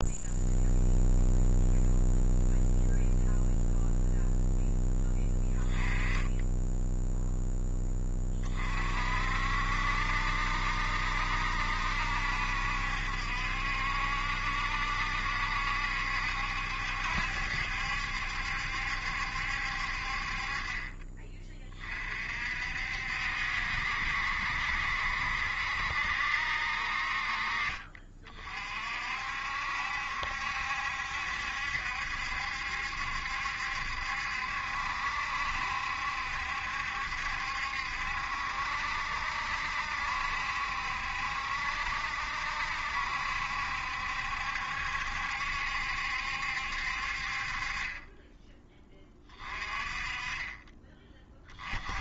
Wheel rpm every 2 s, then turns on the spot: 0, 0, 0, 10, 40, 70, 70, 70, 70, 70, 40, 60, 70, 60, 40, 70, 70, 70, 70, 70, 70, 70, 70, 60, 10, 20.
none